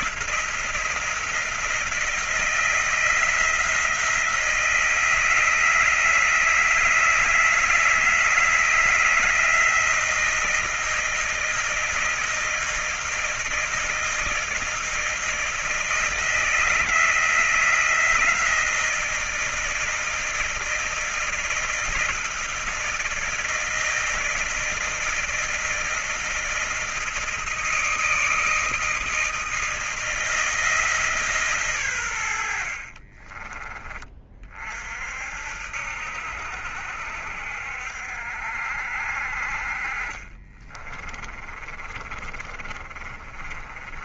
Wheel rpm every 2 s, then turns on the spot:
170, 160, 160, 160, 160, 170, 160, 160, 160, 160, 160, 160, 160, 160, 160, 160, 80, 40, 70, 60, 30, 30.
32-34 40-44